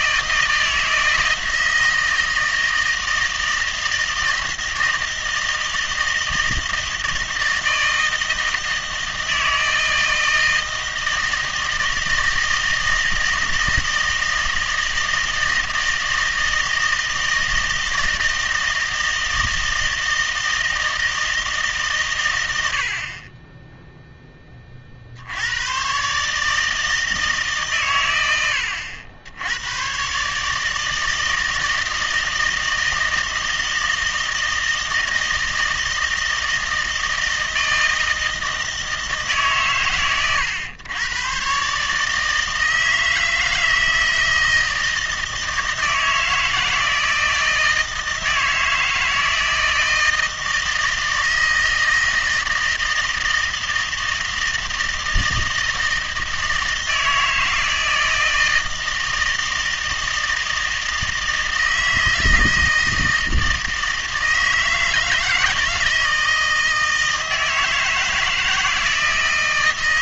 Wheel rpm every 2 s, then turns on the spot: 160, 160, 160, 160, 160, 160, 160, 160, 160, 160, 160, 70, 20, 150, 90, 150, 160, 160, 160, 160, 120, 160, 160, 160, 160, 160, 160, 160, 160, 160, 160, 160, 160, 160, 160.
none